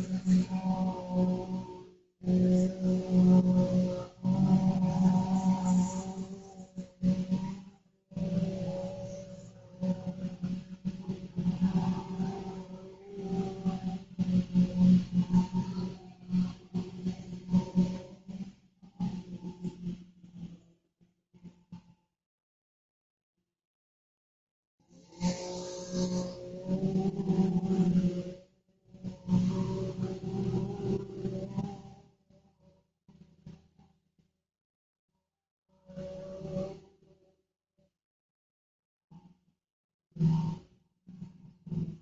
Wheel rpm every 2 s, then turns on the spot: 0, 0, 0, 0, 0, 0, 0, 0, 0, 0, 0, 0, 0, 0, 0, 0, 0, 0, 0, 0, 0.
none